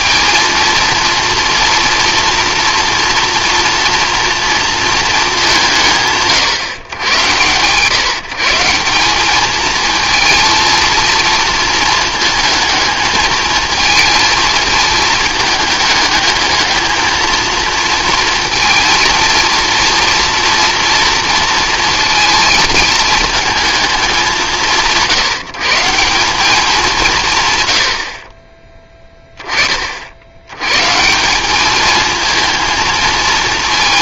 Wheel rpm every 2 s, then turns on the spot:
230, 230, 230, 120, 170, 230, 220, 220, 220, 230, 240, 220, 170, 190, 20, 110, 220.
none